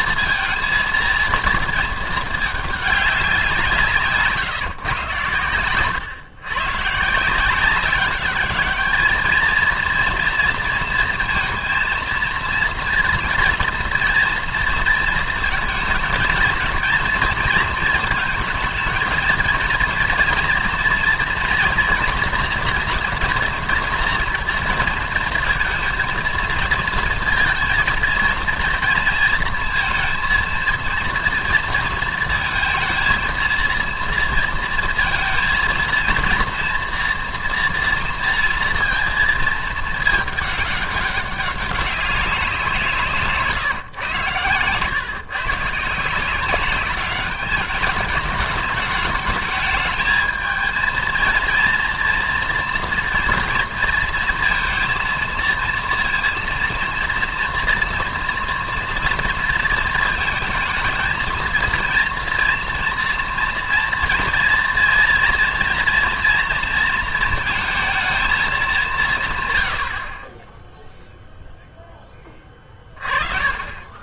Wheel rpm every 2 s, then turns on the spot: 230, 210, 140, 130, 210, 230, 230, 230, 230, 220, 230, 230, 230, 230, 230, 230, 230, 230, 230, 230, 210, 180, 120, 190, 210, 220, 230, 230, 230, 240, 220, 230, 230, 230, 210, 10, 20.
none